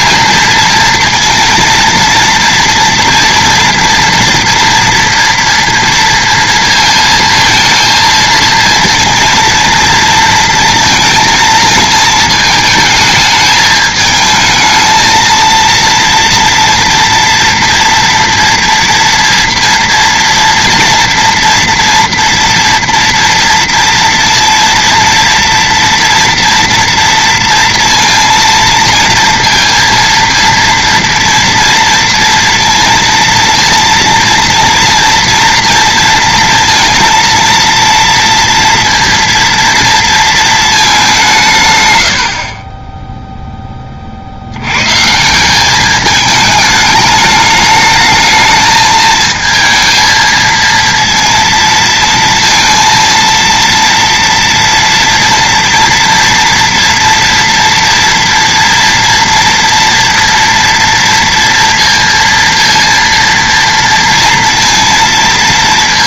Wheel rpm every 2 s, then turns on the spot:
230, 230, 230, 230, 230, 230, 220, 220, 230, 230, 230, 230, 230, 230, 230, 230, 230, 230, 230, 230, 220, 30, 100, 210, 220, 230, 230, 230, 230, 230, 230, 230, 230.
none